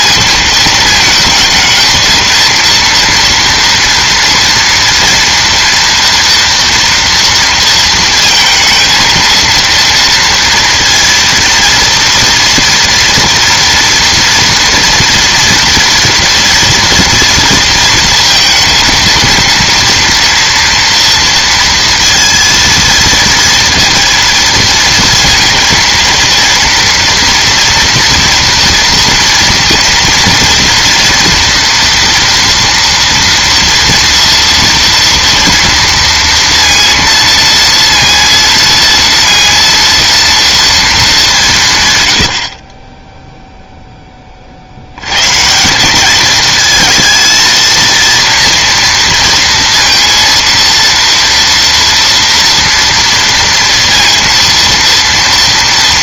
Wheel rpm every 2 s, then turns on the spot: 220, 230, 230, 240, 230, 230, 230, 230, 230, 230, 230, 230, 230, 230, 230, 230, 230, 230, 230, 230, 220, 30, 80, 220, 230, 230, 230, 230.
none